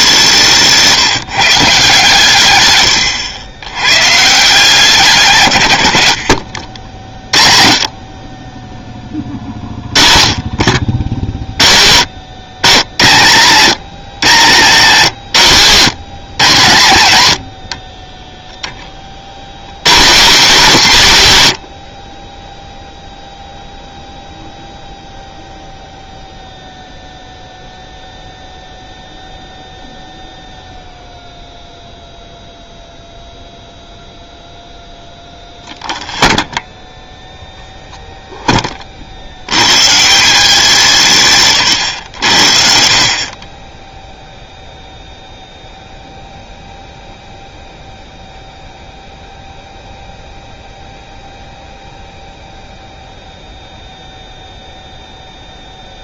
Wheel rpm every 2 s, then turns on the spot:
170, 120, 160, 60, 20, 40, 110, 140, 130, 10, 190, 10, 0, 0, 0, 0, 0, 0, 0, 20, 190, 80, 0, 0, 0, 0, 0, 0.
none